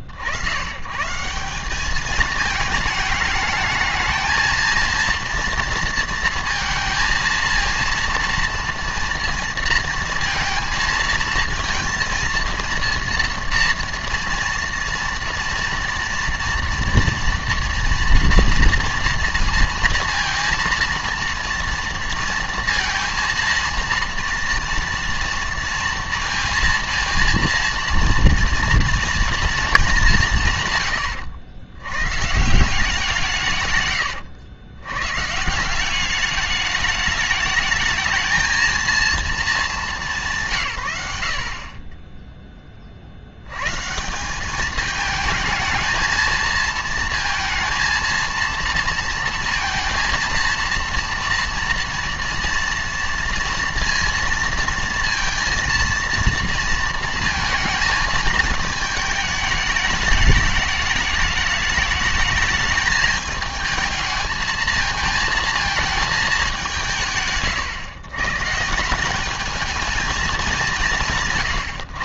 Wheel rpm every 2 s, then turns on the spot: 100, 220, 220, 230, 230, 230, 230, 230, 230, 230, 230, 230, 230, 230, 230, 160, 160, 110, 210, 220, 150, 20, 210, 220, 230, 230, 230, 230, 230, 220, 210, 210, 220, 180, 140, 190.
none